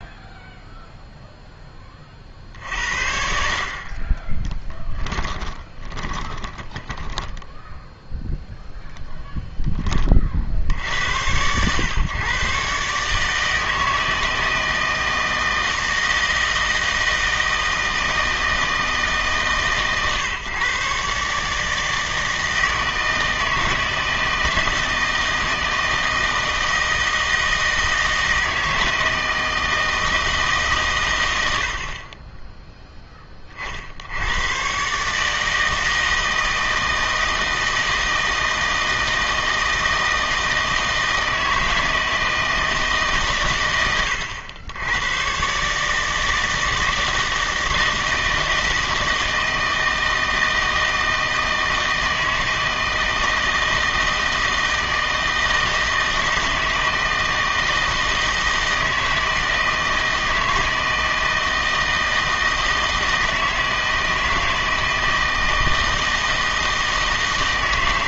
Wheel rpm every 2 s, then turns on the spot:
0, 60, 10, 10, 0, 70, 130, 160, 160, 160, 130, 160, 160, 160, 160, 140, 10, 130, 160, 160, 160, 160, 100, 160, 160, 160, 160, 160, 160, 160, 160, 160, 160, 160.
4-8